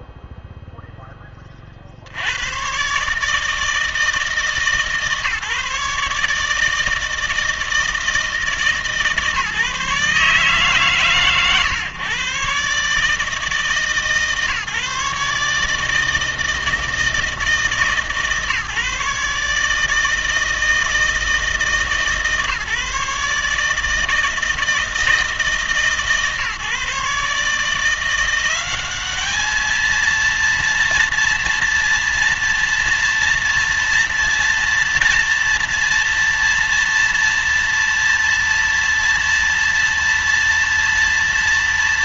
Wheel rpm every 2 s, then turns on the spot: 0, 120, 150, 160, 150, 140, 140, 140, 160, 150, 160, 150, 160, 140, 190, 230, 230, 230, 230, 230, 230.
none